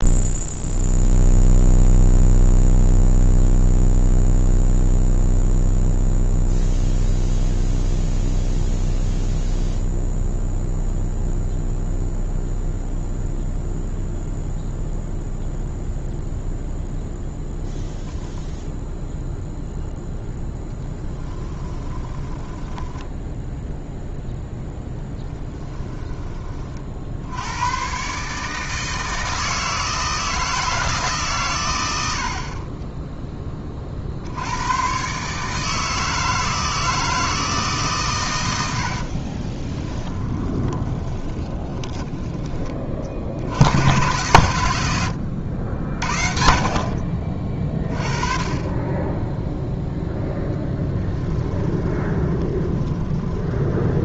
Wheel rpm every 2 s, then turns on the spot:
0, 0, 0, 0, 0, 0, 0, 0, 0, 0, 10, 10, 10, 50, 160, 160, 20, 120, 160, 70, 20, 40, 90, 40, 20, 10, 20.
22-24 32-34 38-42 50-54